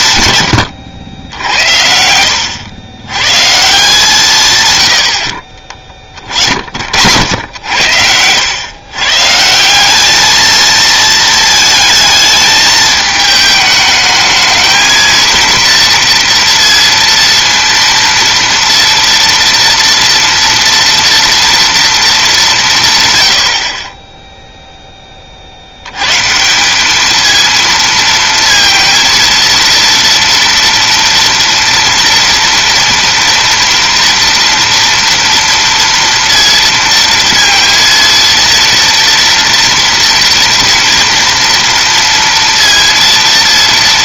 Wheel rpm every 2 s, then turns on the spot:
90, 100, 110, 60, 120, 220, 220, 220, 230, 230, 240, 150, 10, 200, 230, 230, 230, 230, 230, 230, 230, 230.
none